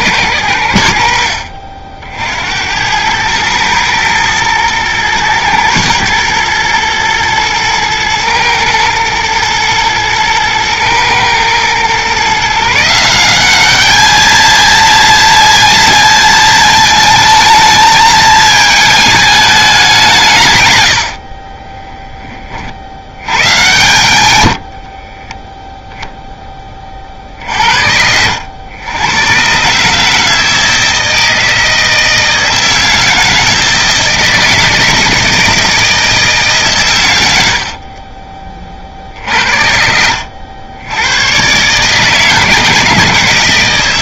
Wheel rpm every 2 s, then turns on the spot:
80, 100, 110, 110, 110, 110, 170, 230, 220, 220, 100, 40, 50, 40, 100, 160, 160, 160, 110, 50, 100, 150.
24-26